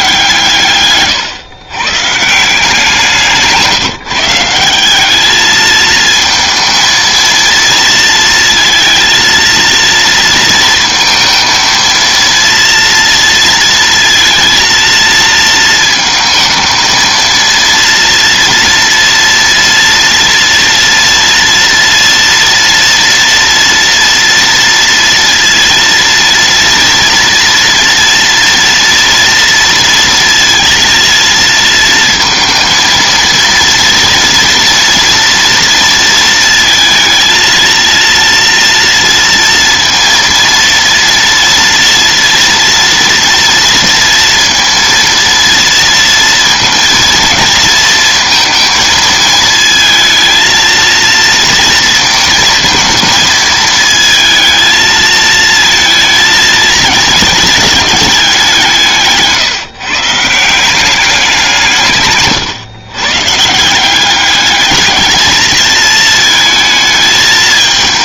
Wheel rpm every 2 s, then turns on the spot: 130, 170, 200, 230, 230, 230, 230, 230, 230, 230, 230, 230, 230, 240, 230, 230, 230, 230, 230, 230, 230, 240, 230, 230, 220, 230, 230, 220, 220, 160, 190, 130, 210, 220.
0-2 58-60